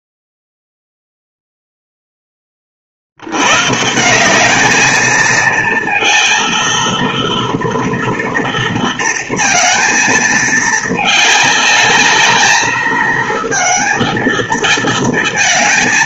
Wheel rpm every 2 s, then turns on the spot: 0, 30, 210, 230, 230, 220, 220, 230.
none